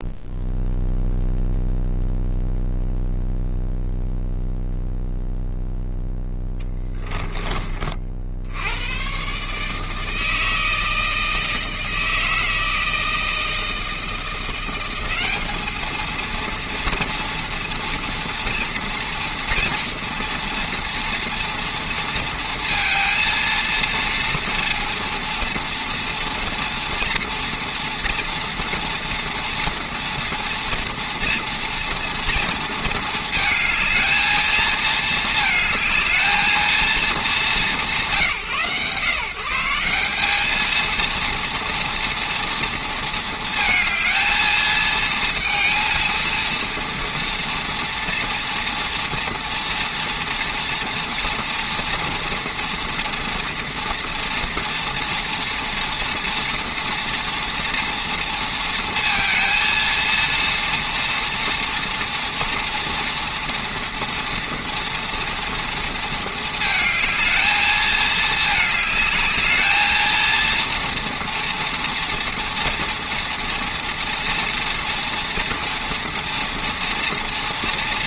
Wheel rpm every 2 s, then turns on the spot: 0, 0, 0, 10, 100, 160, 160, 190, 230, 240, 230, 230, 230, 230, 230, 230, 220, 220, 200, 140, 230, 230, 220, 230, 230, 230, 230, 230, 230, 230, 230, 230, 240, 220, 210, 230, 230, 240, 230.
none